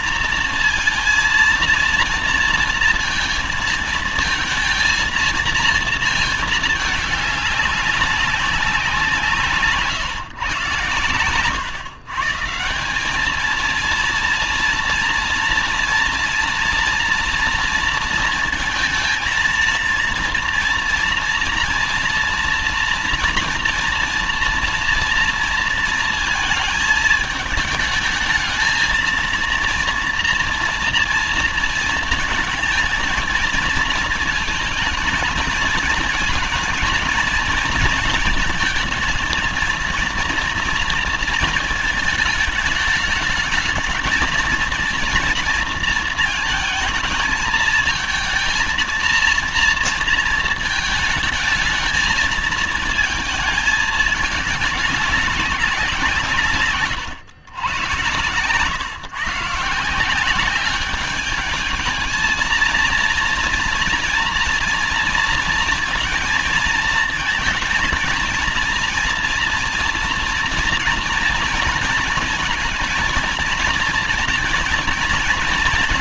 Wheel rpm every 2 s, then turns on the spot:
230, 230, 230, 220, 190, 130, 160, 230, 240, 230, 230, 230, 240, 230, 220, 230, 220, 230, 230, 220, 230, 220, 220, 230, 230, 230, 220, 200, 150, 120, 190, 230, 230, 220, 230, 240, 230, 230.
none